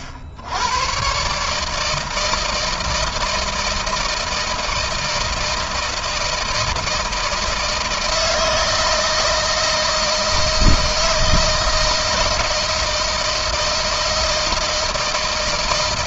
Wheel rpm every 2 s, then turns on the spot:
90, 160, 160, 160, 160, 160, 160, 160.
none